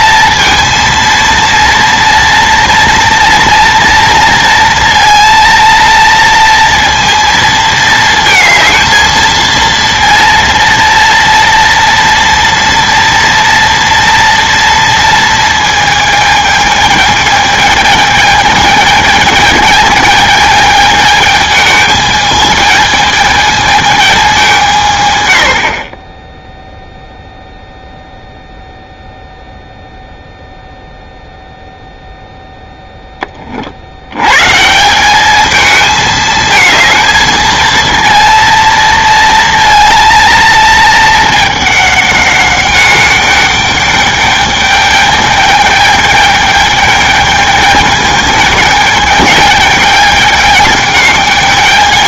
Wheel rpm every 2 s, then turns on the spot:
230, 230, 230, 230, 220, 230, 240, 230, 220, 220, 220, 220, 180, 0, 0, 0, 0, 140, 220, 230, 220, 200, 210, 210, 210, 210.
none